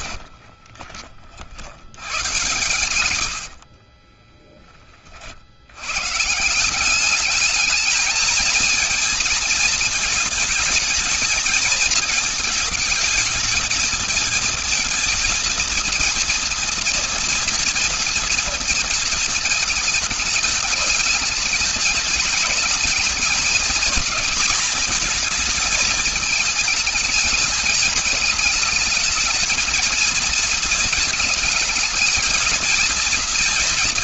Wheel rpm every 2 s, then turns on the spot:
50, 90, 20, 150, 220, 220, 220, 220, 230, 230, 220, 210, 220, 220, 210, 230, 230.
0-2